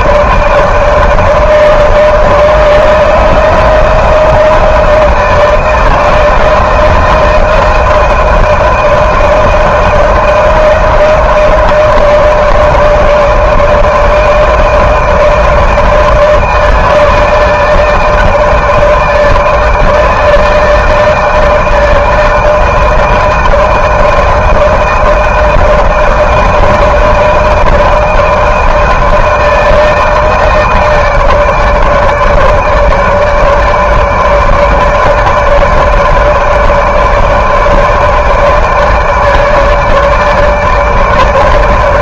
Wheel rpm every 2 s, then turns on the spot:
160, 160, 160, 160, 160, 160, 160, 160, 160, 160, 160, 160, 160, 160, 160, 160, 150, 150, 150, 150, 150.
none